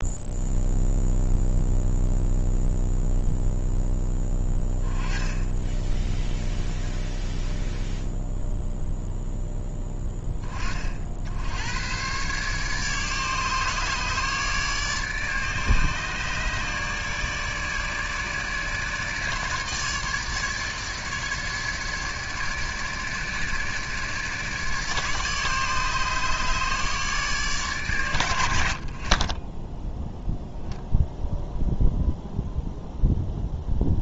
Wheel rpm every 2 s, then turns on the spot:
0, 0, 20, 10, 0, 30, 140, 150, 150, 150, 150, 150, 150, 150, 70, 0, 0.
none